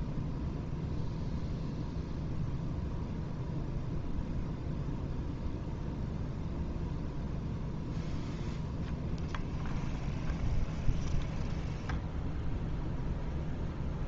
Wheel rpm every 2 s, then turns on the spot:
0, 0, 0, 0, 10, 10, 0.
8-12